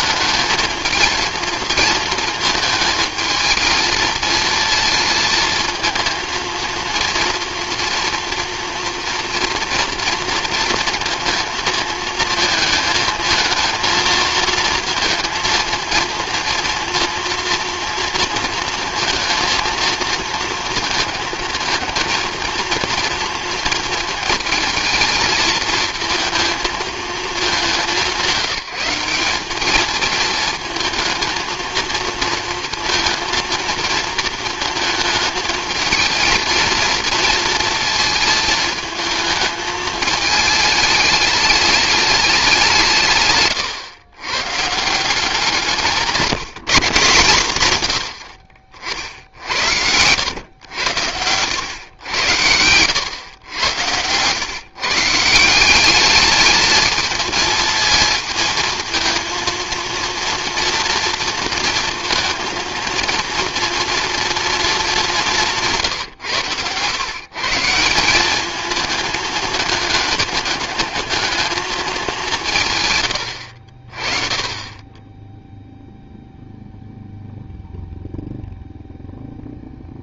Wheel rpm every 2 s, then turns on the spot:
220, 220, 220, 230, 230, 230, 230, 230, 230, 230, 220, 230, 220, 220, 180, 220, 230, 230, 220, 220, 220, 200, 120, 170, 70, 100, 90, 120, 210, 230, 230, 230, 230, 120, 210, 210, 180, 20, 0, 0.
none